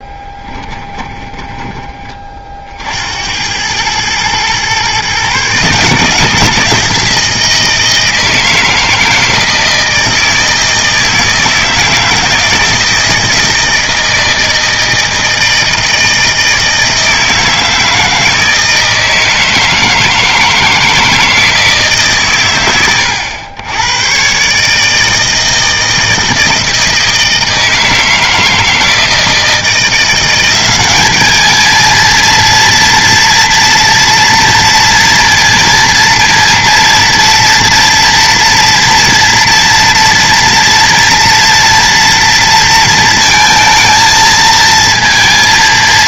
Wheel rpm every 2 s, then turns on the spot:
20, 60, 120, 170, 170, 160, 160, 160, 160, 160, 160, 110, 140, 160, 160, 190, 230, 230, 230, 230, 230, 230, 220.
0-2